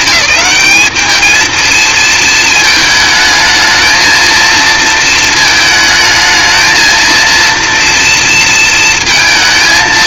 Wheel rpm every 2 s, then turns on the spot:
210, 220, 230, 220, 230.
none